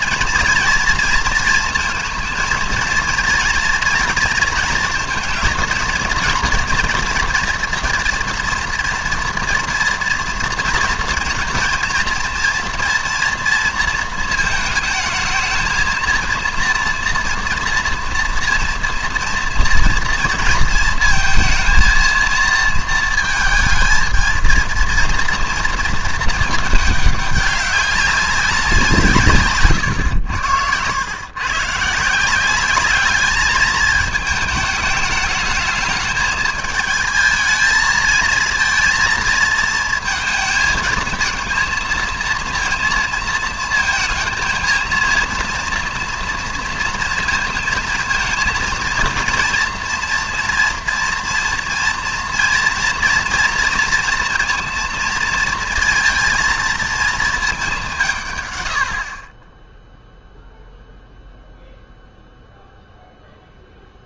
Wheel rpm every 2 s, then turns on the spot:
230, 230, 230, 230, 230, 230, 240, 220, 230, 230, 230, 230, 230, 210, 190, 90, 190, 210, 220, 230, 220, 230, 230, 230, 230, 230, 230, 230, 230, 110, 0, 0.
none